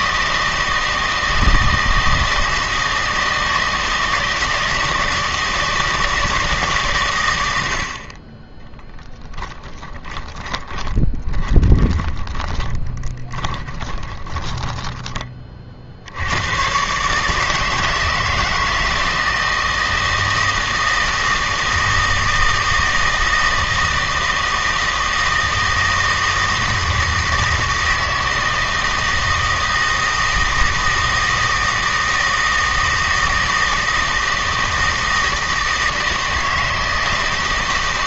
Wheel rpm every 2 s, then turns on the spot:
160, 160, 160, 150, 20, 20, 30, 20, 120, 160, 160, 160, 160, 160, 160, 160, 160, 160, 160.
10-16